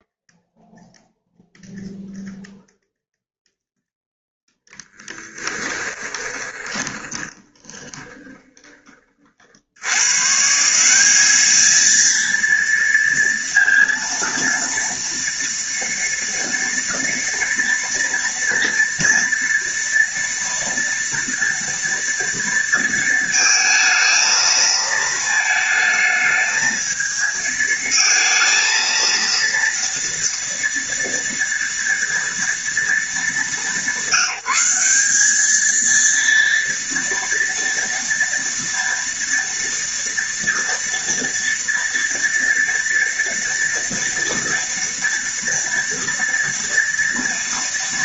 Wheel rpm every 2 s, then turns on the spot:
0, 0, 10, 20, 30, 180, 230, 230, 230, 230, 230, 230, 220, 220, 230, 230, 220, 200, 230, 230, 230, 230, 230, 230.
4-8